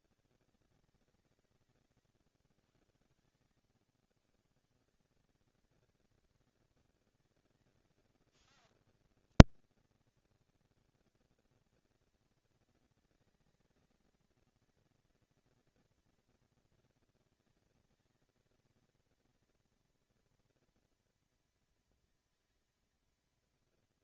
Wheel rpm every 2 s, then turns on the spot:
200, 130, 130, 210, 230, 220, 230, 230, 230, 230, 230, 230.
none